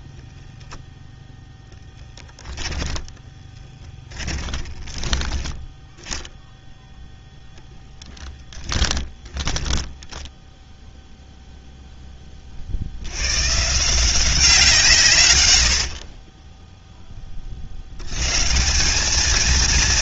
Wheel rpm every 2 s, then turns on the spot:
10, 10, 10, 0, 10, 0, 90, 150, 10, 180.
2-6 8-10 14-16